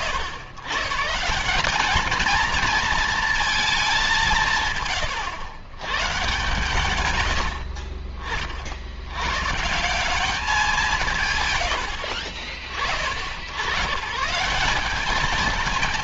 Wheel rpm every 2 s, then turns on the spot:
120, 220, 150, 130, 60, 200, 60, 170.
none